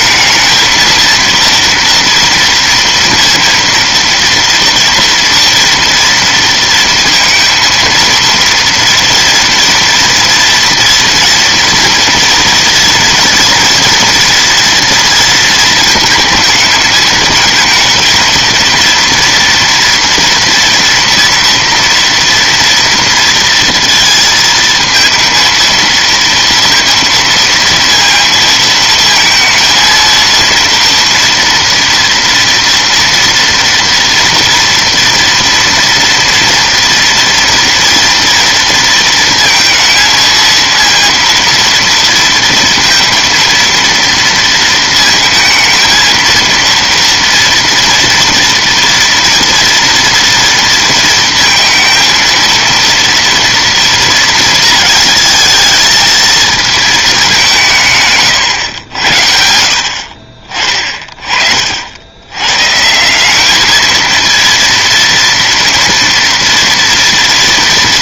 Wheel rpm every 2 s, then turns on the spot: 230, 230, 230, 230, 230, 230, 230, 230, 220, 230, 230, 230, 230, 230, 230, 230, 240, 230, 230, 230, 230, 230, 230, 230, 240, 230, 230, 220, 220, 100, 30, 150, 230, 230.
none